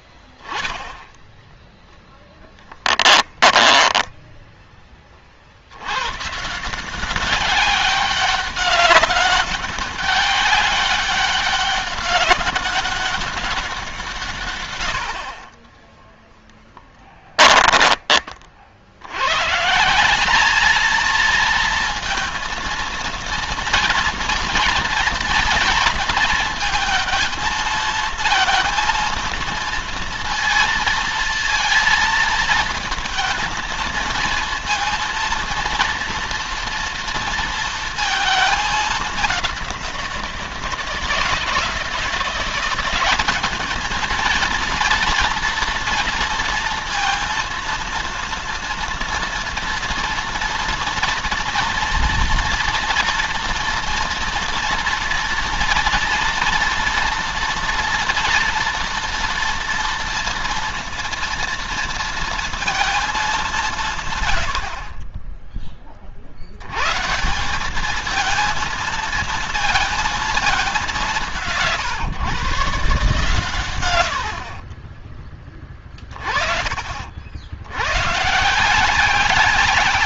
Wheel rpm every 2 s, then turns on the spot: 10, 10, 20, 170, 200, 200, 200, 100, 10, 70, 220, 230, 230, 220, 230, 230, 220, 230, 230, 210, 170, 180, 230, 230, 230, 230, 240, 230, 230, 230, 230, 220, 50, 110, 220, 190, 140, 30, 40, 170.
2-4 16-18 74-76